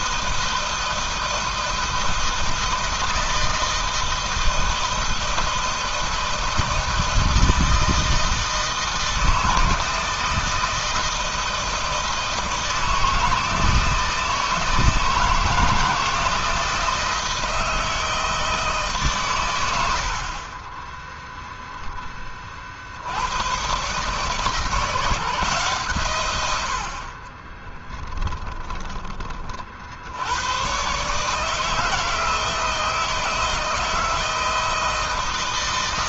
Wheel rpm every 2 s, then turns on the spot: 160, 160, 160, 160, 160, 160, 160, 160, 160, 160, 30, 40, 150, 100, 20, 110, 160, 160.
28-30